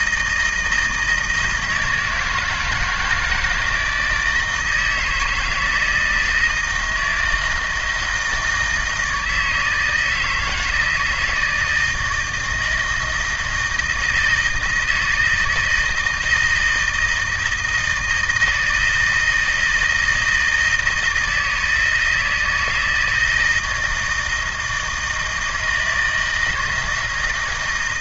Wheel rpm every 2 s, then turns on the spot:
160, 160, 160, 160, 160, 160, 160, 160, 160, 160, 160, 170, 160, 160.
none